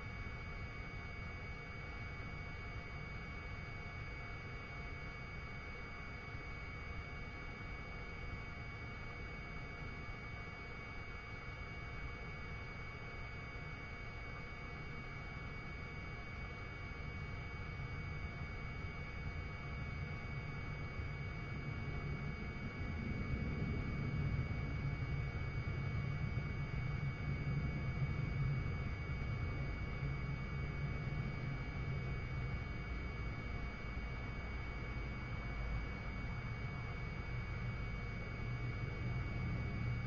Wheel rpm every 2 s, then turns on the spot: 0, 0, 0, 0, 0, 0, 0, 0, 0, 0, 0, 0, 0, 0, 0, 0, 0, 0, 0, 0.
none